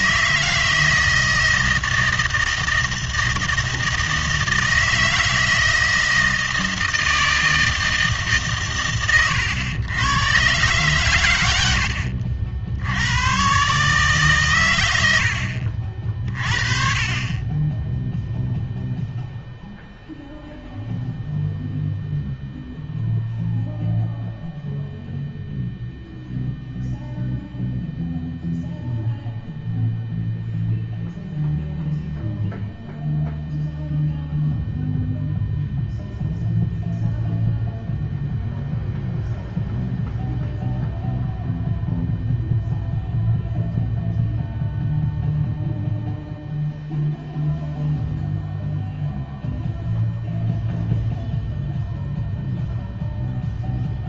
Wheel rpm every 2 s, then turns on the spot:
160, 160, 160, 160, 130, 120, 70, 120, 40, 0, 0, 0, 0, 0, 0, 0, 0, 0, 0, 0, 0, 0, 0, 0, 0, 0, 0.
none